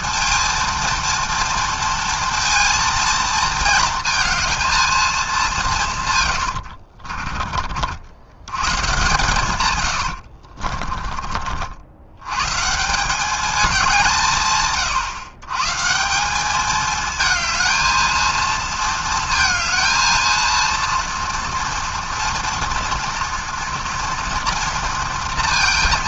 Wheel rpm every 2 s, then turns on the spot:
230, 230, 220, 70, 120, 30, 160, 130, 210, 220, 230, 230, 230.
6-8 10-12